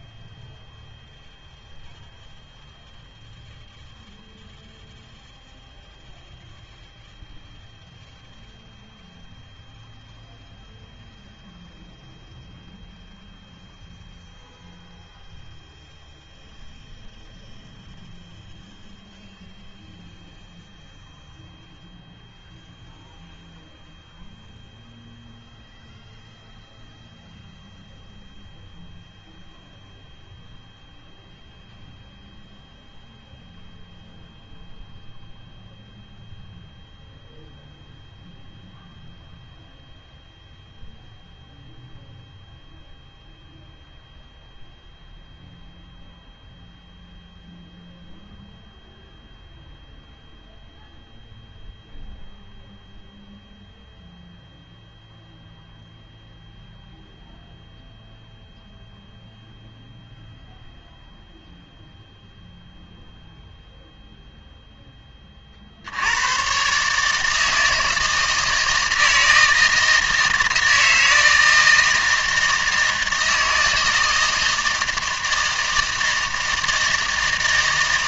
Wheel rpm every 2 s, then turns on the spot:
0, 0, 0, 0, 0, 0, 0, 0, 0, 0, 0, 0, 0, 0, 0, 0, 0, 0, 0, 0, 0, 0, 0, 0, 0, 0, 0, 0, 0, 0, 0, 0, 10, 140, 160, 160, 160, 160, 160.
none